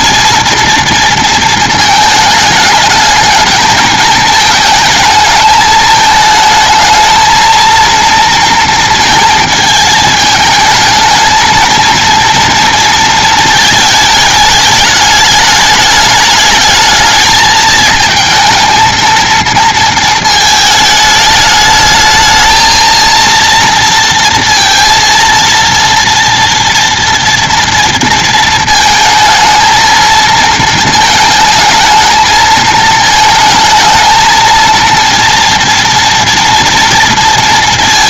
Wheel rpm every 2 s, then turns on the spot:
230, 210, 220, 220, 230, 220, 230, 210, 220, 230, 220, 220, 230, 230, 230, 220, 220, 230, 230.
none